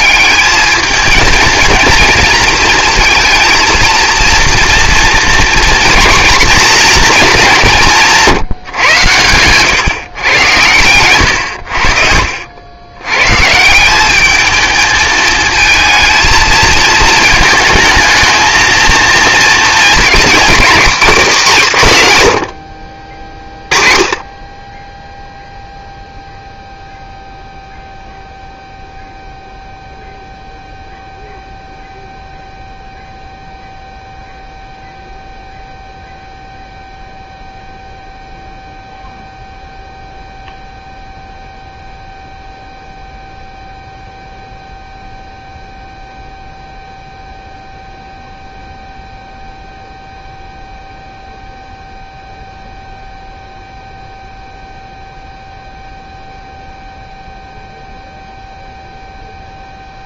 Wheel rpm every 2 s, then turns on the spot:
210, 230, 230, 240, 140, 110, 100, 220, 220, 220, 230, 60, 10, 0, 0, 0, 0, 0, 0, 0, 0, 0, 0, 0, 0, 0, 0, 0, 0, 0.
none